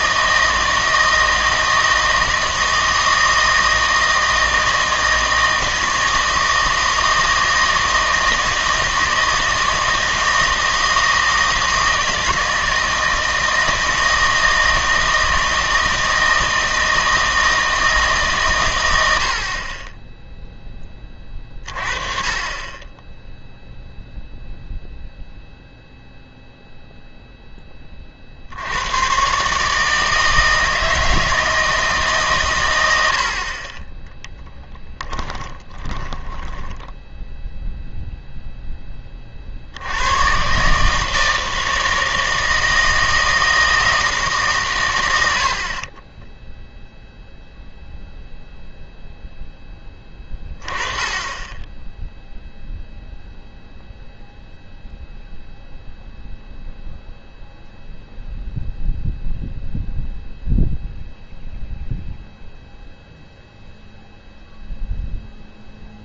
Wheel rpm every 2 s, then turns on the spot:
160, 160, 160, 160, 160, 160, 160, 160, 160, 120, 10, 20, 0, 0, 80, 160, 110, 10, 10, 10, 140, 160, 120, 0, 0, 20, 0, 0, 0, 0, 0, 0, 0.
36-38